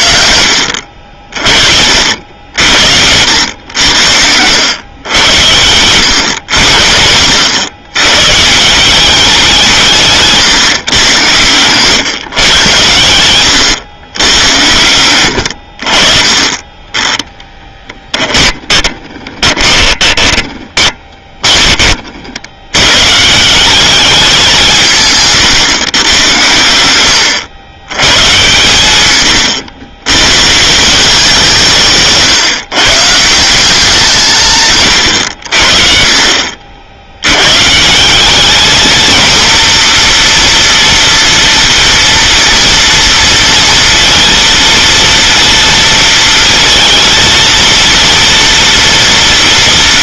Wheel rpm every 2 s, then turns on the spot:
70, 70, 90, 90, 170, 150, 120, 100, 20, 20, 20, 100, 160, 90, 120, 160, 140, 140, 60, 220, 240, 230, 230, 230, 230.
16-22